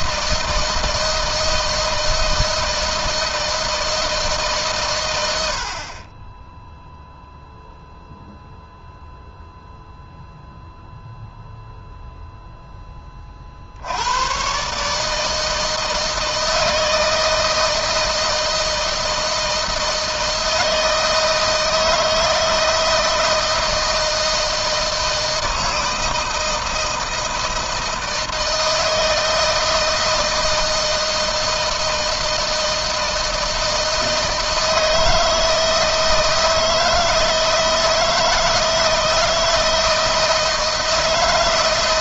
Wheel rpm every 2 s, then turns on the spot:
160, 160, 110, 0, 0, 0, 20, 150, 160, 160, 160, 160, 160, 160, 160, 160, 160, 160, 160, 160, 160.
none